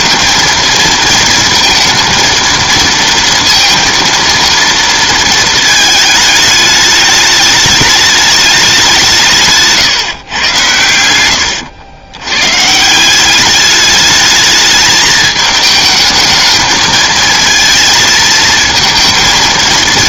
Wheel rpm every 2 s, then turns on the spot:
230, 230, 230, 210, 200, 120, 150, 220, 220, 230.
none